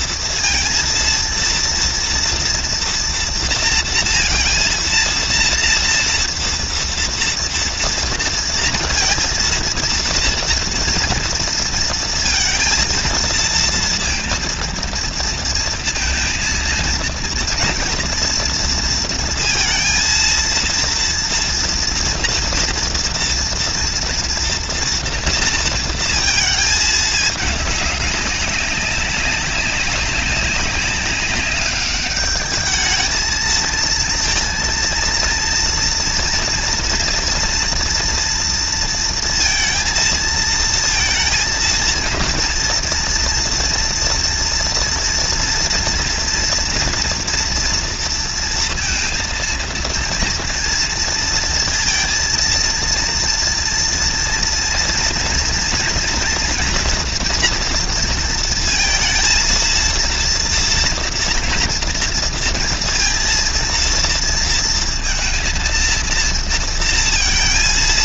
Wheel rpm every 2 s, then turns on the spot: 230, 230, 230, 230, 230, 230, 230, 230, 230, 230, 230, 230, 230, 220, 190, 190, 210, 230, 240, 230, 230, 240, 230, 230, 230, 230, 230, 230, 230, 230, 230, 230, 230, 230.
none